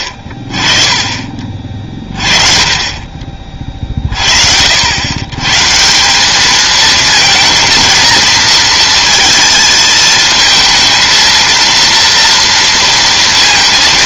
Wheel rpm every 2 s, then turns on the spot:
30, 30, 70, 220, 230, 230, 230.
none